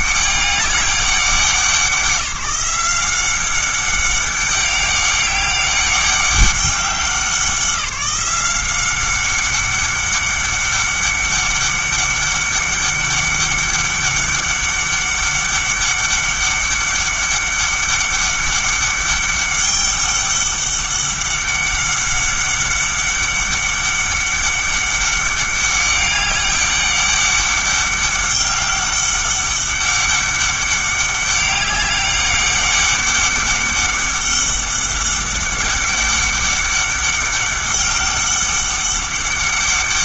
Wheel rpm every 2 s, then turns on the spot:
200, 180, 200, 190, 190, 200, 200, 200, 200, 200, 200, 200, 200, 200, 200, 200, 200, 200, 200, 200.
none